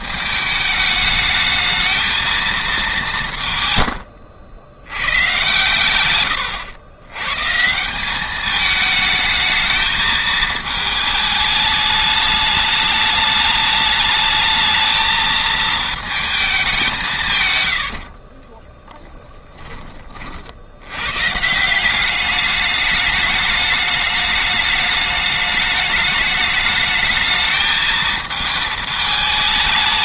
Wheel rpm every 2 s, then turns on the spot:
210, 210, 100, 100, 210, 210, 210, 220, 190, 10, 90, 210, 210, 210, 220.
18-20